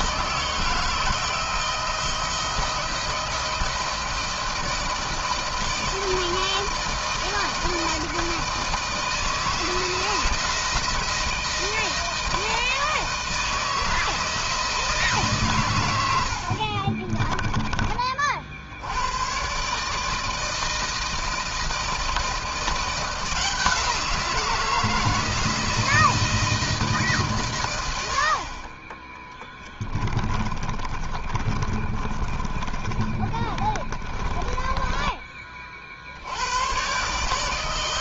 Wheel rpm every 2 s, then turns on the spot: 160, 170, 160, 160, 160, 160, 160, 160, 80, 40, 160, 160, 170, 160, 50, 20, 30, 20, 90.
16-18 30-36